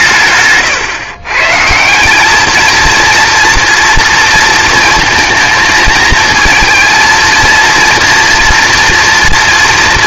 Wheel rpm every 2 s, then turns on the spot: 140, 220, 230, 230, 230.
none